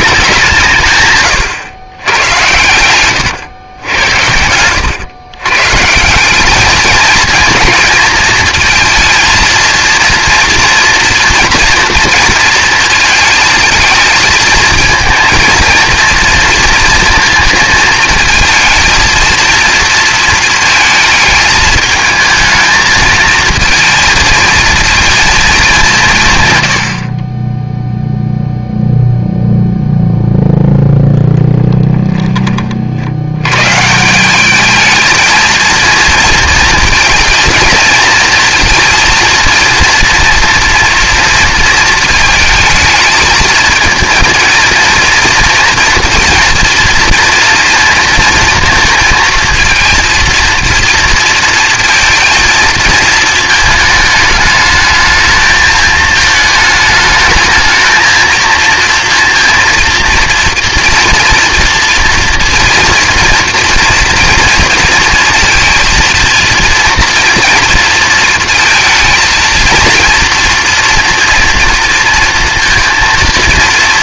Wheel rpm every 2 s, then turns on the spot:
150, 110, 100, 220, 230, 230, 220, 220, 230, 230, 220, 220, 220, 80, 0, 0, 60, 220, 230, 230, 230, 220, 230, 230, 230, 230, 230, 220, 210, 230, 240, 230, 240, 230, 230, 230, 230.
none